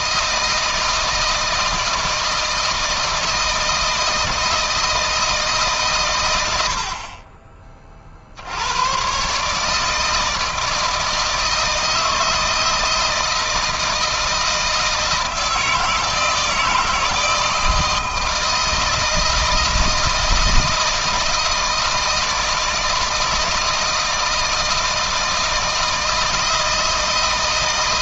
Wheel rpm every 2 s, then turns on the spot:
160, 160, 160, 80, 80, 160, 160, 160, 160, 160, 160, 160, 160, 160.
none